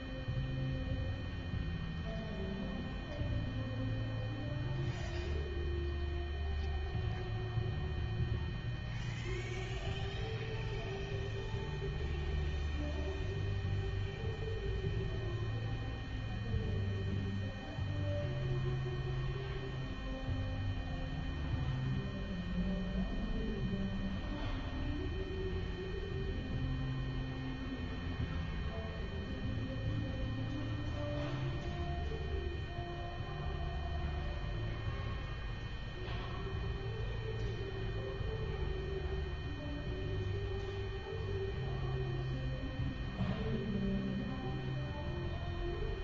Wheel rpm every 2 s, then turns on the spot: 0, 0, 0, 0, 0, 0, 0, 0, 0, 0, 0, 0, 0, 0, 0, 0, 0, 0, 0, 0, 0, 0, 0.
none